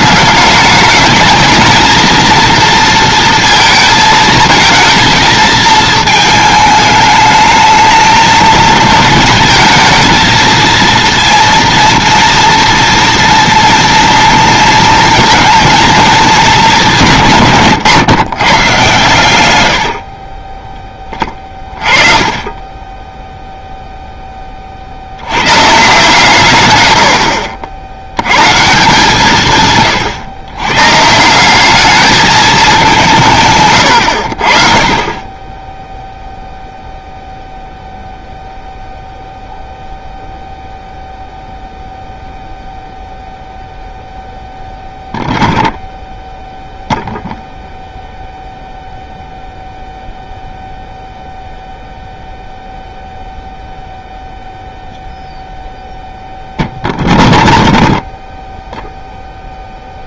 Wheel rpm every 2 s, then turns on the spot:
200, 230, 220, 220, 220, 230, 230, 230, 200, 120, 20, 30, 20, 120, 140, 120, 210, 50, 0, 0, 0, 0, 0, 0, 0, 0, 0, 0, 0, 0.
none